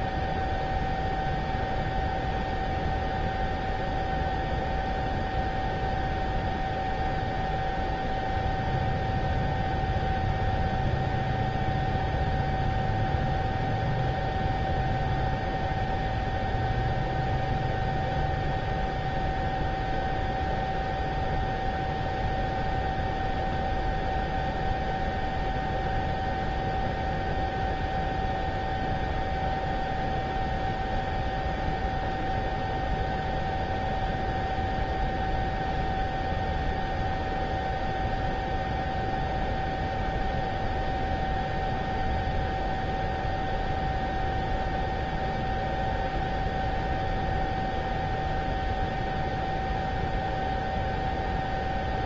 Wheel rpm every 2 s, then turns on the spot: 0, 0, 0, 0, 0, 0, 0, 0, 0, 0, 0, 0, 0, 0, 0, 0, 0, 0, 0, 0, 0, 0, 0, 0, 0, 0.
none